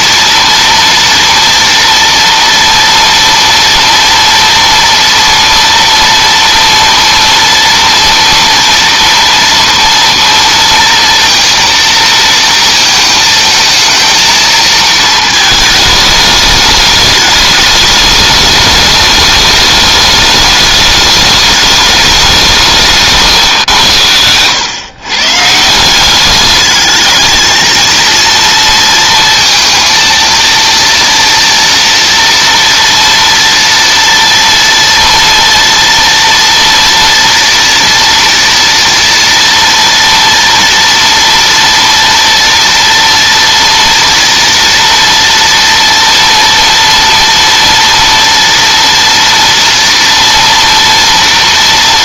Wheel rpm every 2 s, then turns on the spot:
230, 230, 240, 230, 230, 230, 220, 220, 210, 210, 210, 170, 120, 210, 230, 230, 230, 230, 230, 230, 230, 230, 230, 230, 230, 230.
none